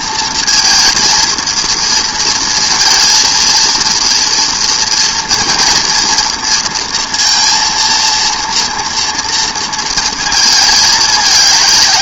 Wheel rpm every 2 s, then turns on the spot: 220, 230, 230, 230, 230, 220.
none